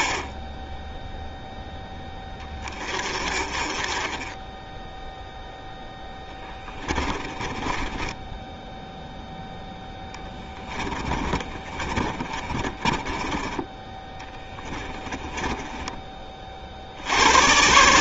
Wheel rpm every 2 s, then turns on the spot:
0, 30, 0, 20, 0, 20, 20, 20, 70.
6-8 10-16